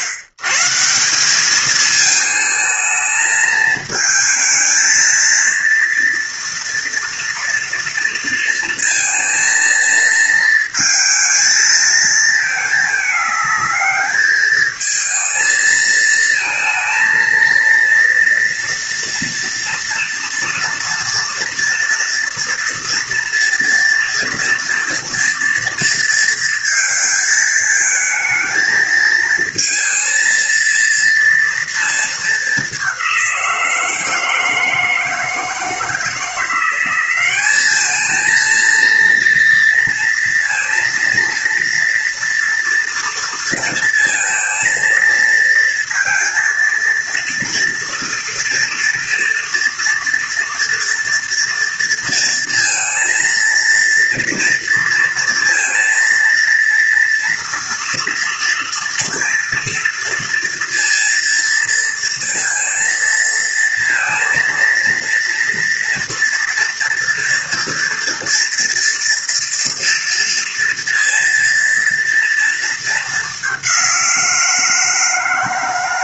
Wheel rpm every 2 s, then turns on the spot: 140, 220, 220, 230, 230, 230, 220, 220, 230, 230, 230, 230, 230, 230, 220, 230, 210, 160, 170, 220, 230, 230, 230, 230, 230, 230, 230, 230, 230, 230, 230, 230, 230, 230, 230, 230, 230, 170.
none